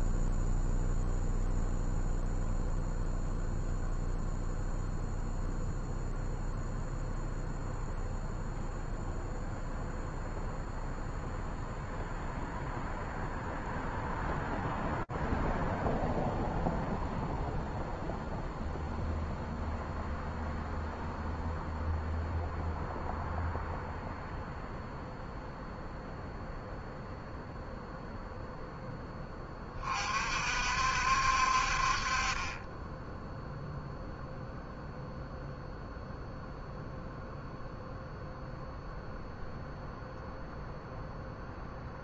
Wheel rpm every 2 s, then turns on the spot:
0, 0, 0, 0, 0, 0, 0, 0, 0, 0, 0, 0, 0, 0, 40, 40, 0, 0, 0, 0, 0.
none